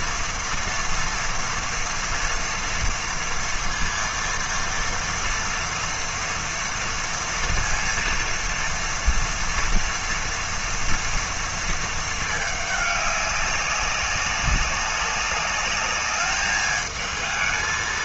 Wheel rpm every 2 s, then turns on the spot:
230, 230, 230, 230, 230, 230, 200, 190, 220.
none